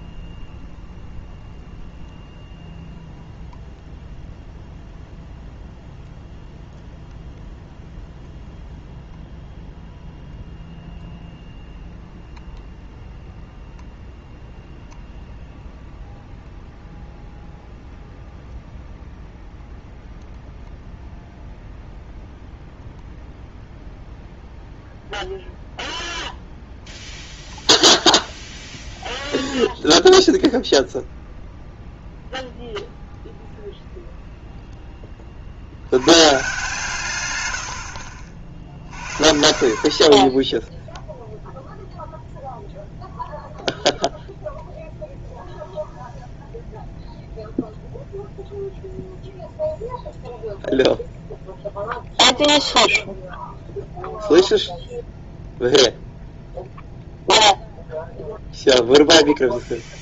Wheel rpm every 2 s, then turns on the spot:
0, 0, 0, 0, 0, 0, 0, 0, 0, 0, 0, 0, 0, 0, 0, 0, 0, 0, 140, 50, 10, 0, 0, 0, 0, 0, 0, 0, 0, 0.
none